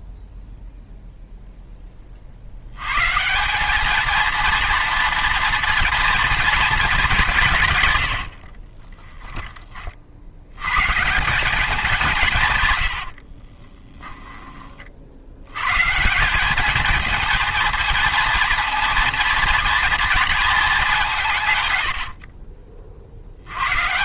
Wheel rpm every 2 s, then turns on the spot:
0, 70, 230, 230, 50, 100, 140, 30, 200, 230, 220, 40.
8-10 22-24